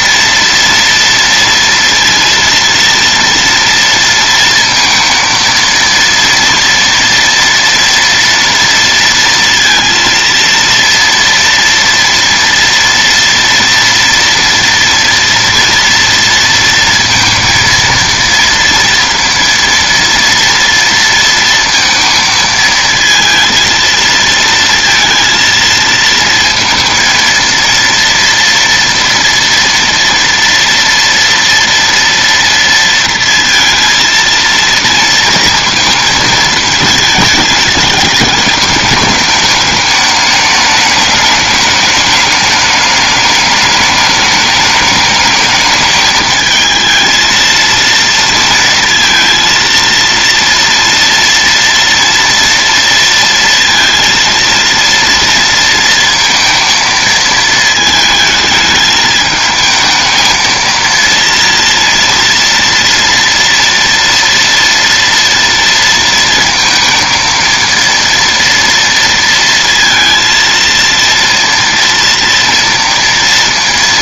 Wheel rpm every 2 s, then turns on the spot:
230, 230, 230, 230, 230, 230, 230, 240, 230, 230, 230, 230, 230, 230, 230, 230, 230, 230, 220, 210, 210, 210, 210, 220, 230, 230, 230, 230, 230, 220, 220, 230, 230, 230, 230, 230, 230.
none